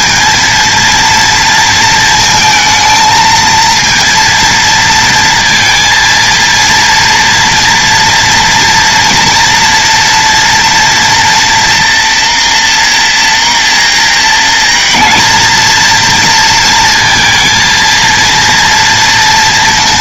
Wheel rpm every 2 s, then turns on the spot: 230, 220, 230, 230, 240, 230, 240, 230, 230, 230.
none